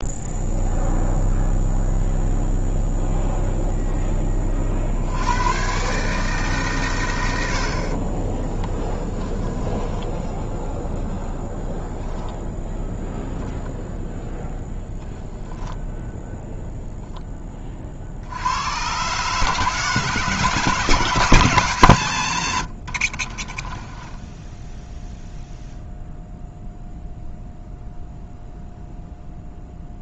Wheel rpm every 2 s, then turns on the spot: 0, 0, 50, 140, 20, 0, 0, 10, 0, 90, 150, 110, 10, 0, 0.
8-10 22-26